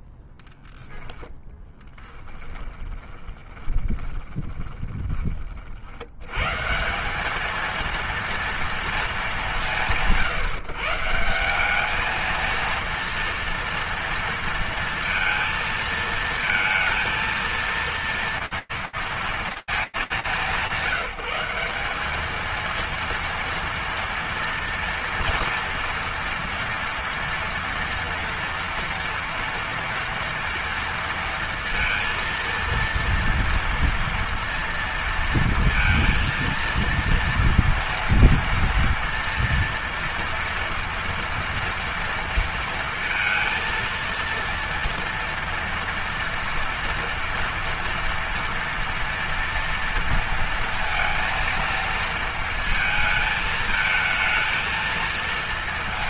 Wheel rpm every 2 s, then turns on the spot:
10, 20, 30, 200, 200, 160, 230, 230, 230, 230, 190, 230, 230, 230, 230, 230, 230, 230, 230, 230, 230, 230, 230, 230, 230, 230, 220, 230.
0-4